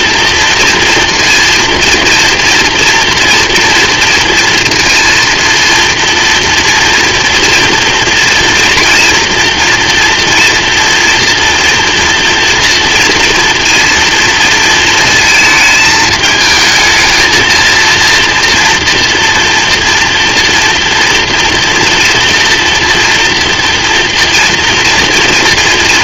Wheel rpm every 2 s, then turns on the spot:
230, 230, 230, 230, 230, 230, 230, 230, 220, 230, 230, 230, 240.
none